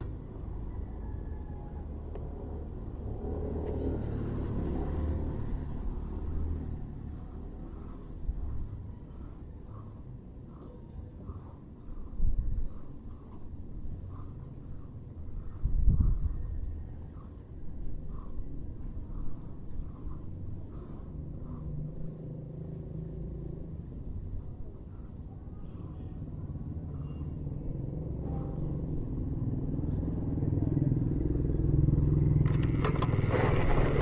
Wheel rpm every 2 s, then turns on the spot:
0, 0, 0, 0, 0, 0, 0, 0, 0, 0, 0, 0, 0, 0, 0, 0, 10.
32-34